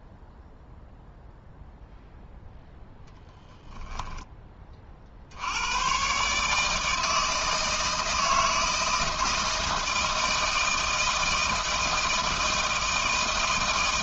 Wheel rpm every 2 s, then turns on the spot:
0, 0, 30, 160, 160, 160, 160.
none